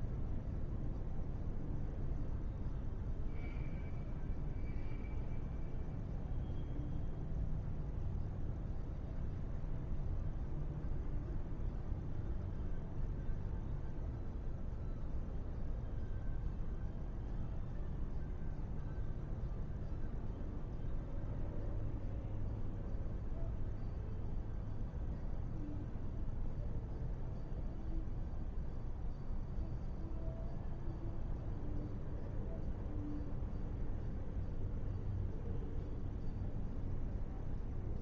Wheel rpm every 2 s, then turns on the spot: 0, 0, 0, 0, 0, 0, 0, 0, 0, 0, 0, 0, 0, 0, 0, 0, 0, 0, 0.
none